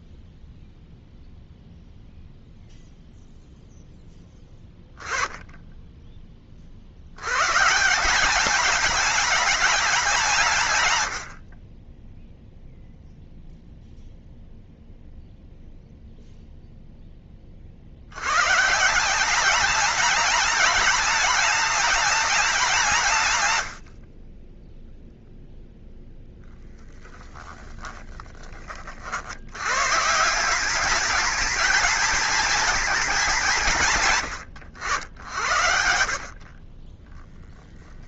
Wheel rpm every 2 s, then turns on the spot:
0, 0, 10, 70, 210, 100, 0, 0, 10, 170, 210, 170, 0, 10, 50, 200, 220, 100, 10.
26-28